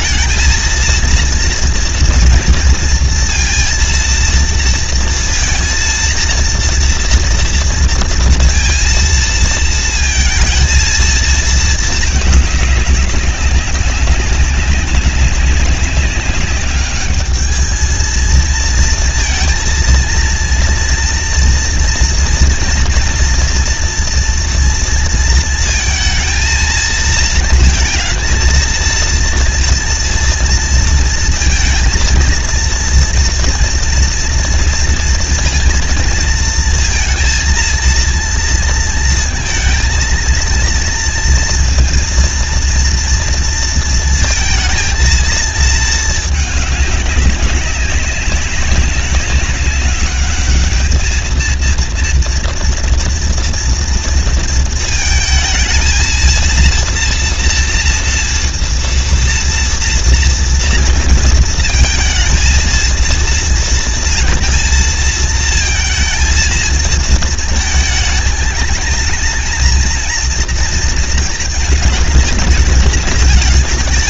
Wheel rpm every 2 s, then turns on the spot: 230, 230, 230, 230, 230, 230, 210, 200, 200, 220, 230, 230, 230, 220, 230, 230, 230, 230, 230, 230, 230, 230, 230, 210, 200, 210, 230, 230, 230, 230, 230, 230, 230, 230, 220, 230, 220.
none